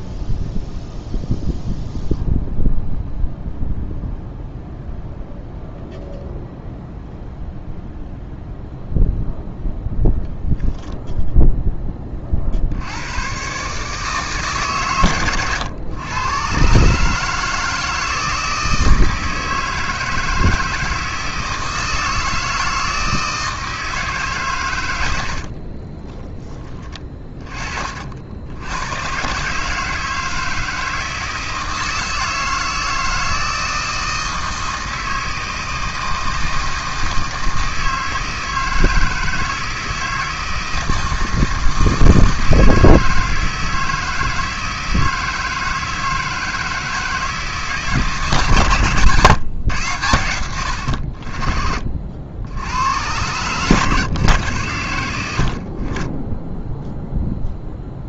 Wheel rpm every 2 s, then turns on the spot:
0, 0, 0, 0, 0, 0, 80, 120, 150, 160, 160, 160, 100, 20, 100, 160, 160, 160, 160, 160, 160, 160, 160, 160, 140, 80, 110, 90, 0.
none